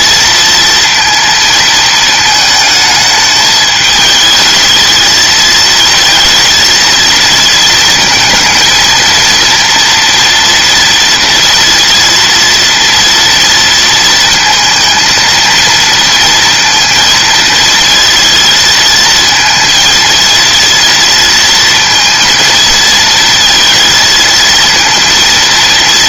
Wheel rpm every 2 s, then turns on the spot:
230, 220, 220, 230, 230, 230, 230, 230, 230, 220, 230, 230, 230.
none